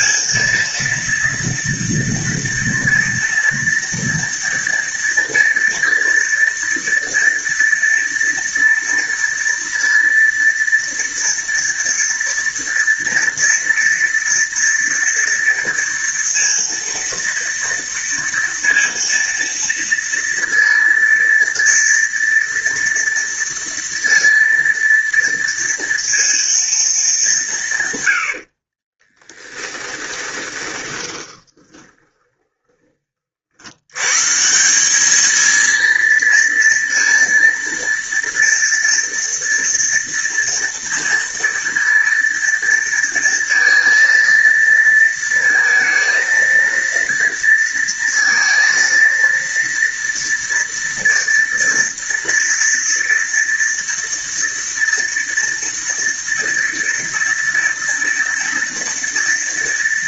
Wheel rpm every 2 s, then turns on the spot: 230, 230, 230, 230, 230, 230, 230, 230, 230, 230, 230, 230, 230, 230, 50, 20, 20, 170, 230, 230, 230, 230, 230, 230, 230, 230, 230, 230, 230, 230.
28-34